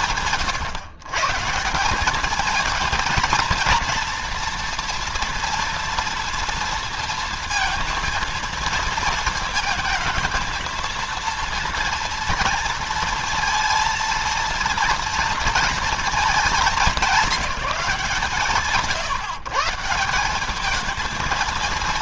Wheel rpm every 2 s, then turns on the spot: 150, 220, 240, 230, 230, 230, 230, 230, 200, 150, 200.
none